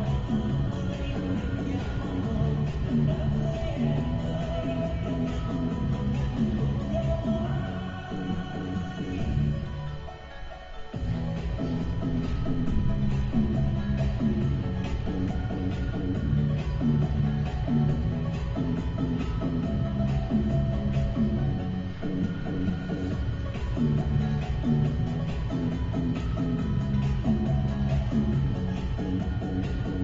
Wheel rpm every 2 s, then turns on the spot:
0, 0, 0, 0, 0, 0, 0, 0, 0, 0, 0, 0, 0, 0, 0.
none